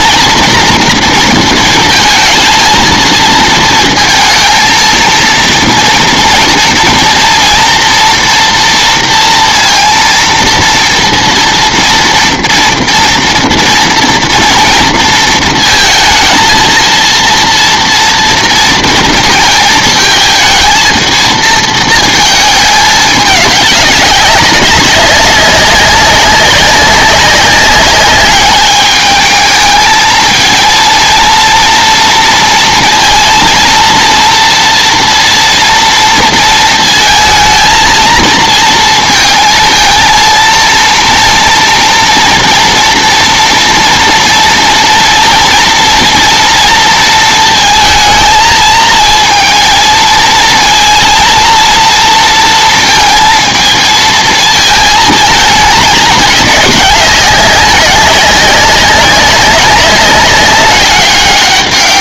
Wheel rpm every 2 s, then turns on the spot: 230, 230, 230, 230, 230, 230, 230, 230, 230, 230, 230, 210, 190, 200, 210, 230, 230, 230, 230, 230, 230, 230, 230, 230, 220, 230, 230, 220, 200, 190, 200.
none